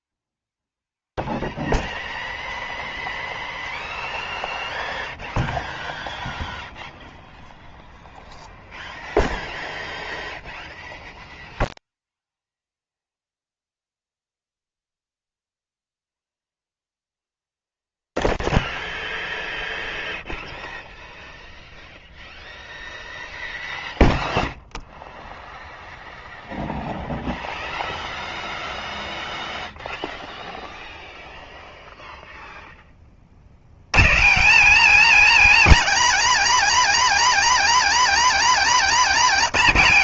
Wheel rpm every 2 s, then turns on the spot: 0, 0, 0, 0, 0, 0, 0, 0, 0, 0, 0, 0, 0, 0, 0, 0, 0, 230, 280, 290.
none